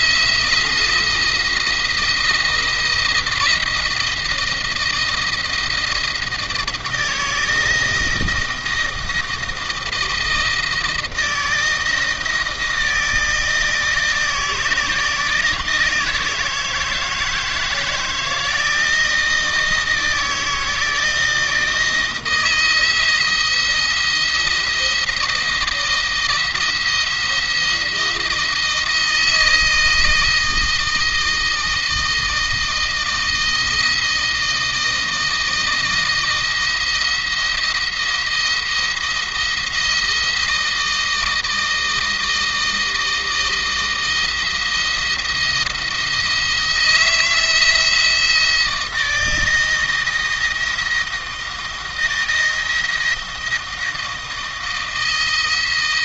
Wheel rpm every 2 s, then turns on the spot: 170, 170, 160, 160, 160, 160, 160, 160, 160, 160, 160, 170, 170, 170, 160, 160, 160, 160, 170, 170, 160, 160, 170, 160, 170, 160, 160, 170.
none